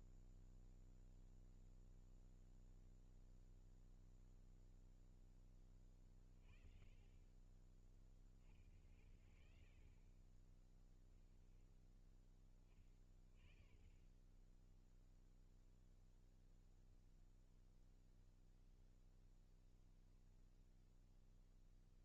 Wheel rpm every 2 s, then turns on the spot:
0, 0, 0, 20, 50, 10, 50, 0, 0, 0, 0.
none